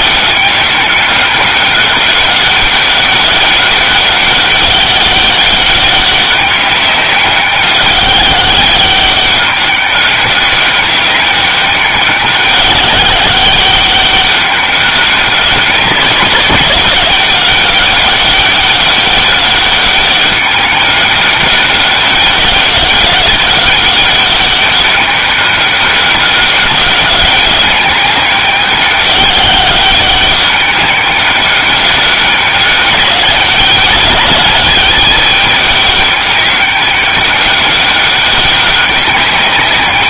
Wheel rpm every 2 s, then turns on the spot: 200, 200, 200, 190, 200, 200, 200, 200, 190, 200, 200, 200, 200, 190, 200, 200, 200, 210, 200, 190.
none